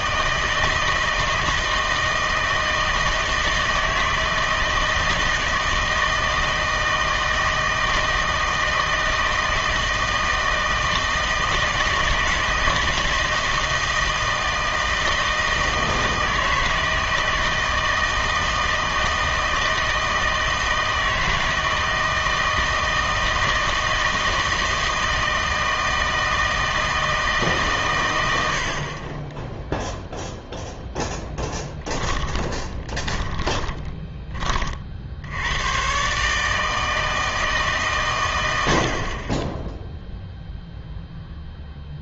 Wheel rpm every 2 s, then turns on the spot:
160, 160, 160, 160, 160, 160, 160, 160, 160, 160, 160, 160, 160, 160, 60, 0, 20, 40, 160, 70, 0.
32-34